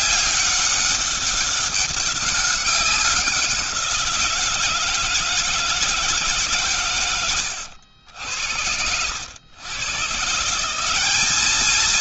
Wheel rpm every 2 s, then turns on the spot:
200, 200, 170, 150, 80, 160.
none